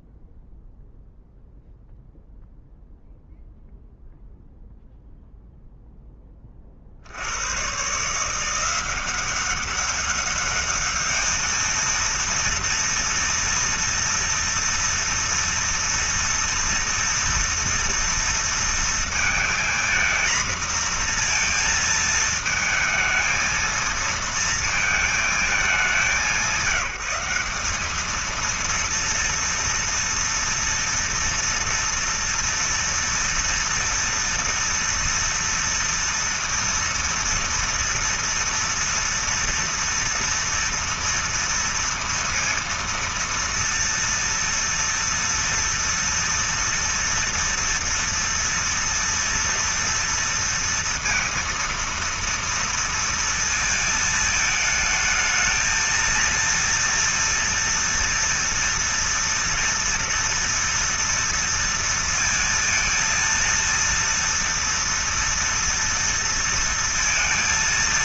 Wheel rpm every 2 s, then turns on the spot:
0, 0, 0, 40, 180, 210, 230, 230, 230, 230, 240, 220, 230, 190, 230, 230, 230, 230, 230, 240, 230, 230, 230, 230, 230, 230, 230, 220, 230, 230, 230, 230, 230, 230.
none